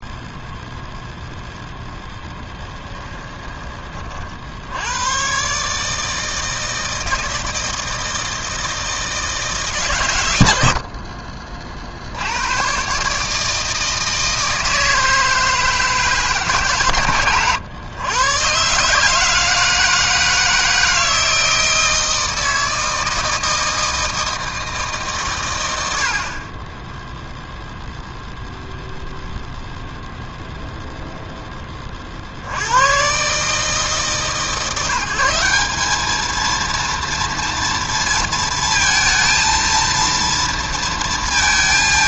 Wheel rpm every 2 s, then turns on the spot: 0, 10, 80, 160, 160, 80, 110, 160, 140, 130, 160, 160, 160, 20, 0, 0, 90, 160, 230, 230, 230.
2-4